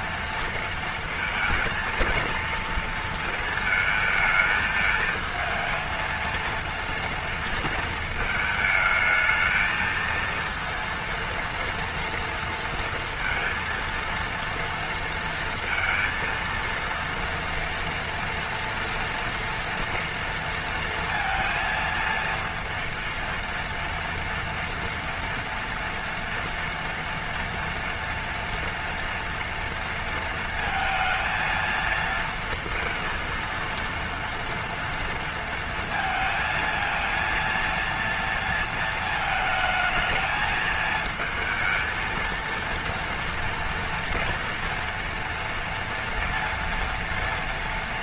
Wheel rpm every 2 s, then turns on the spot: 230, 230, 220, 230, 220, 230, 230, 230, 230, 230, 230, 230, 230, 230, 230, 230, 230, 230, 230, 230, 220, 230, 230, 230.
none